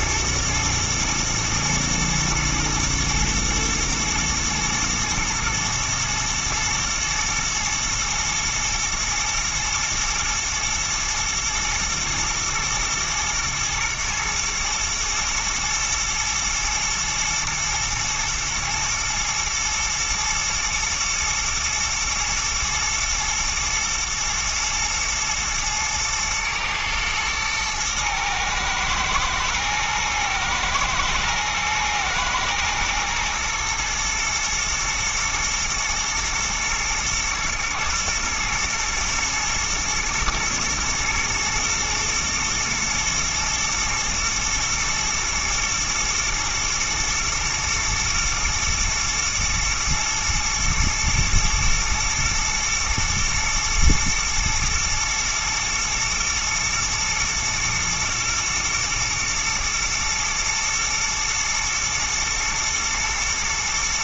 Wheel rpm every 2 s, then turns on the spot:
110, 110, 120, 110, 120, 120, 120, 120, 110, 120, 110, 110, 120, 110, 120, 110, 110, 120, 120, 110, 110, 110, 120, 110, 110, 110, 120, 110, 120, 110, 110, 120.
none